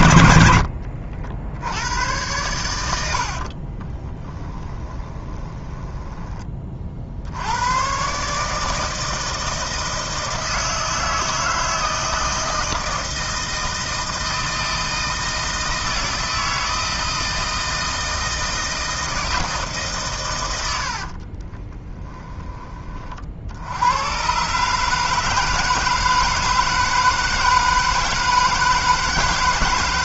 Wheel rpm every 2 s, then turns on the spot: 70, 80, 20, 60, 160, 160, 160, 160, 160, 160, 50, 40, 150, 160, 160.
2-6 20-22